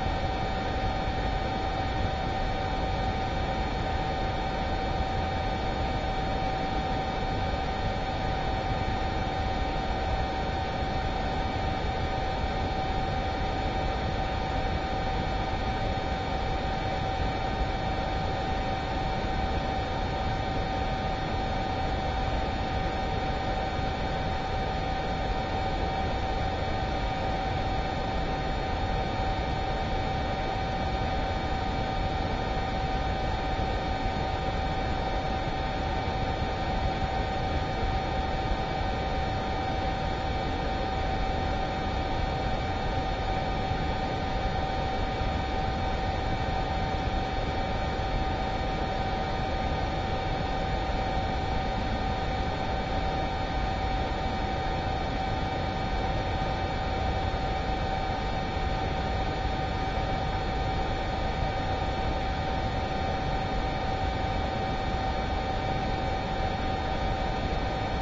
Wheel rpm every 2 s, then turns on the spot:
0, 0, 0, 0, 0, 0, 0, 0, 0, 0, 0, 0, 0, 0, 0, 0, 0, 0, 0, 0, 0, 0, 0, 0, 0, 0, 0, 0, 0, 0, 0, 0, 0, 0.
none